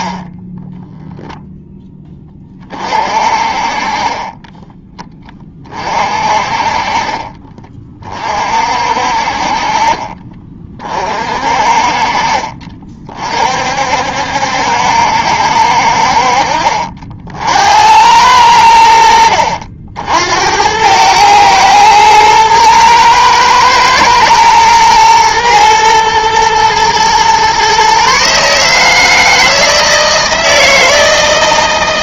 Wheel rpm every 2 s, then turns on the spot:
0, 30, 10, 40, 50, 40, 40, 70, 50, 90, 90, 110, 110, 120, 150, 160.
none